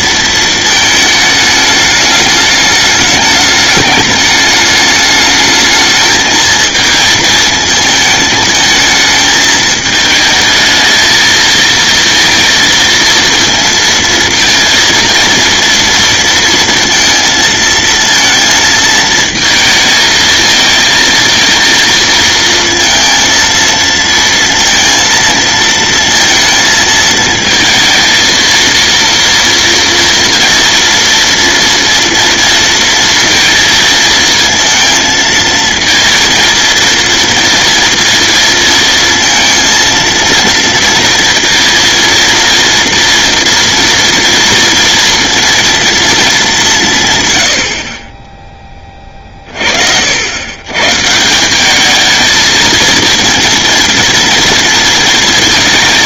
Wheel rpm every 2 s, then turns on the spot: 220, 210, 210, 220, 220, 220, 230, 230, 230, 220, 230, 230, 230, 230, 230, 230, 230, 230, 230, 230, 230, 230, 230, 160, 20, 130, 220, 230.
none